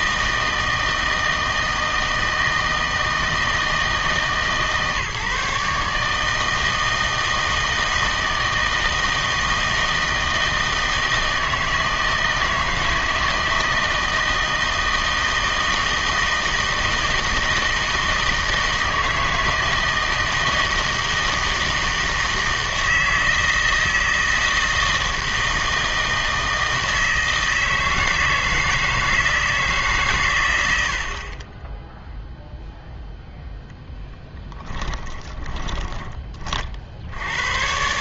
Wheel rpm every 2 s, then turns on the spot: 160, 160, 150, 160, 160, 160, 160, 160, 160, 160, 160, 160, 160, 160, 160, 110, 0, 10, 50.
34-36